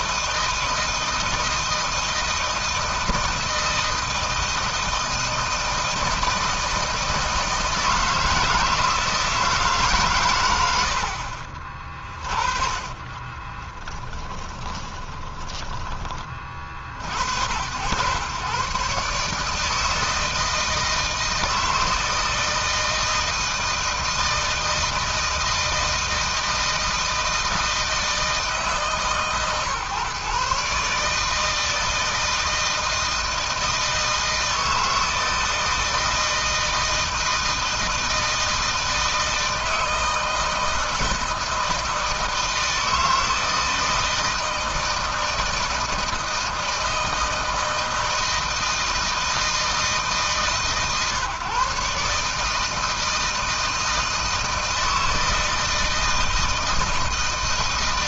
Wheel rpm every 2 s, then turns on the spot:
160, 160, 160, 160, 160, 60, 30, 20, 70, 140, 160, 160, 160, 160, 150, 150, 160, 160, 160, 160, 160, 160, 160, 160, 160, 130, 160, 160, 160.
10-16